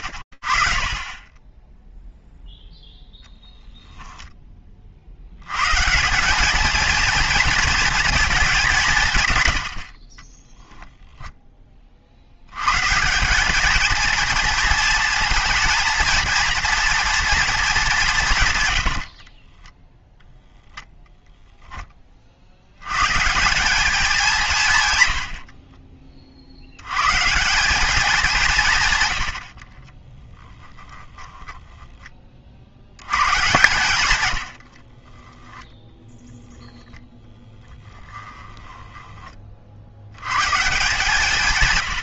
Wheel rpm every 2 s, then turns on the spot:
40, 0, 10, 210, 200, 10, 100, 230, 230, 120, 0, 70, 150, 80, 170, 10, 50, 70, 10, 20, 120.
10-12 18-20 30-32 34-36 38-40